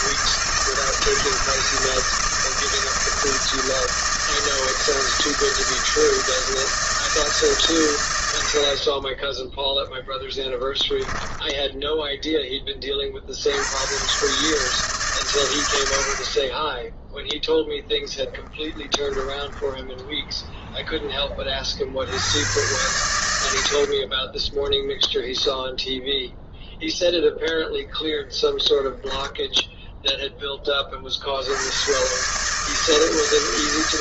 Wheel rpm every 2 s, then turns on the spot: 170, 160, 160, 160, 60, 10, 20, 140, 10, 10, 0, 90, 10, 0, 10, 20, 150.
10-12 18-20 28-30